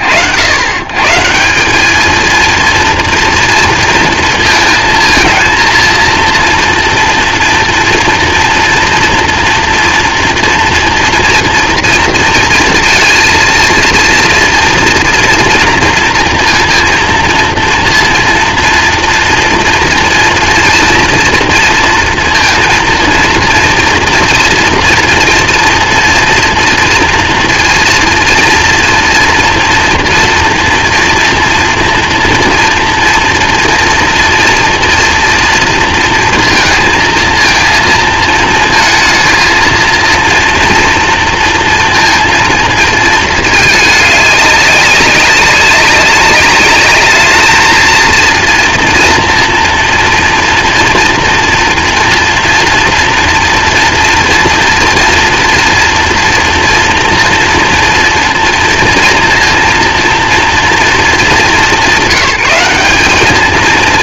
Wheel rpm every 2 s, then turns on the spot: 110, 230, 230, 230, 240, 230, 230, 230, 230, 230, 230, 230, 230, 230, 230, 230, 230, 230, 230, 230, 230, 220, 200, 210, 240, 230, 230, 230, 230, 230, 210, 210.
none